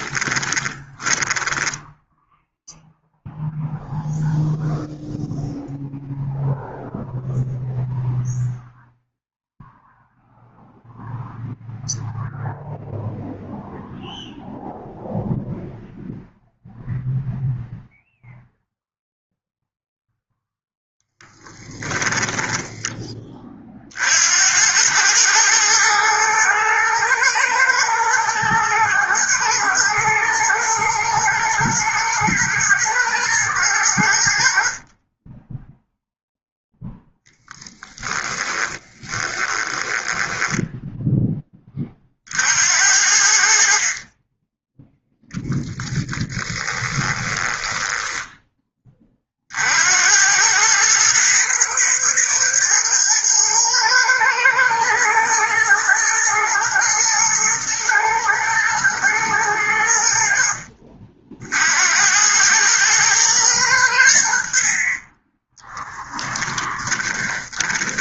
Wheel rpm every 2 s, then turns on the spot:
20, 0, 0, 0, 0, 0, 0, 0, 0, 0, 0, 10, 100, 110, 110, 110, 110, 30, 0, 10, 10, 80, 0, 10, 30, 110, 110, 110, 120, 110, 50, 110, 30, 20.
0-2 38-40 46-48 66-68